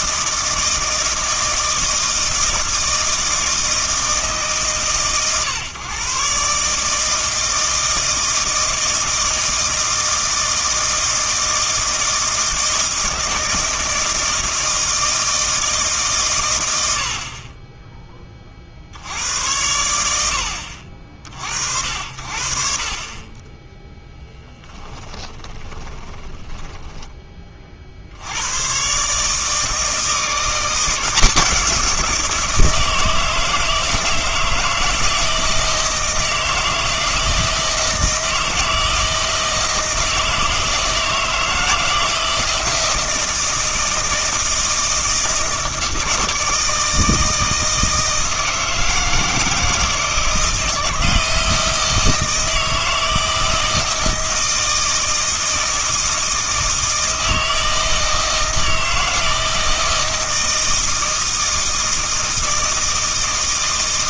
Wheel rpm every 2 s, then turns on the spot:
160, 160, 130, 150, 160, 160, 160, 160, 90, 50, 60, 50, 10, 20, 130, 180, 160, 160, 160, 160, 160, 160, 160, 160, 160, 160, 160, 160, 160, 160, 160, 160.
24-28